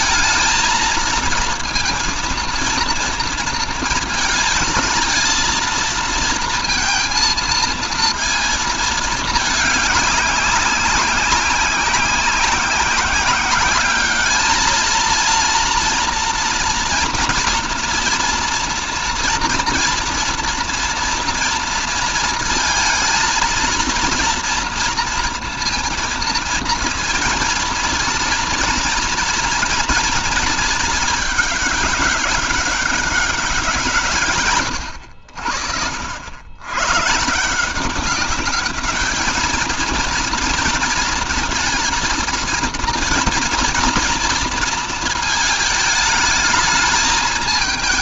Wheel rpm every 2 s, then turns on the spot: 230, 230, 230, 230, 230, 190, 190, 220, 230, 230, 230, 230, 230, 230, 230, 220, 200, 130, 110, 210, 230, 230, 230, 220.
none